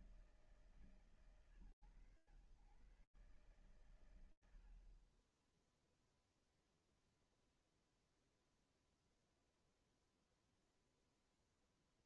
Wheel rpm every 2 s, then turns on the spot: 110, 130, 20, 0, 0, 0.
none